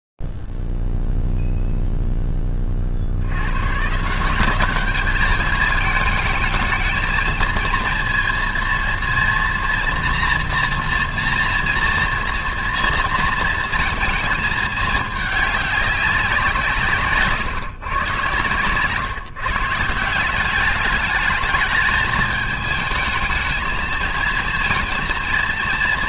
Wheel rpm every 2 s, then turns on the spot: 0, 0, 130, 210, 230, 230, 230, 230, 200, 120, 160, 210, 220.
none